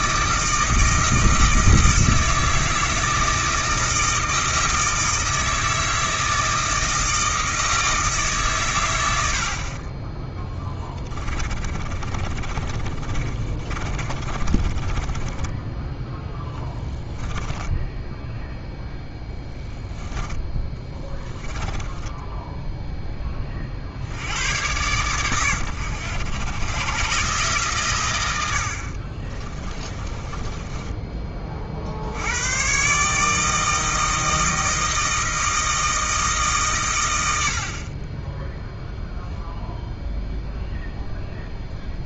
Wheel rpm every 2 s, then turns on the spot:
160, 160, 160, 160, 130, 10, 30, 30, 10, 0, 10, 0, 100, 110, 70, 20, 120, 160, 150, 10, 0.
10-18 20-22 30-32